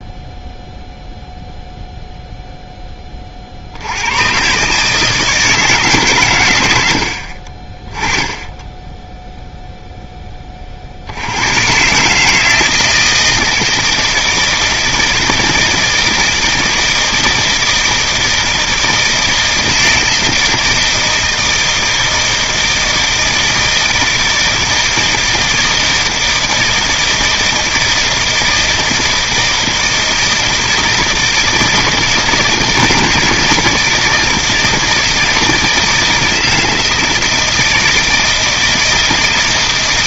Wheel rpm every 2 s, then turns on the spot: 0, 10, 150, 90, 10, 50, 160, 160, 160, 160, 160, 160, 160, 160, 160, 160, 160, 160, 160, 160.
none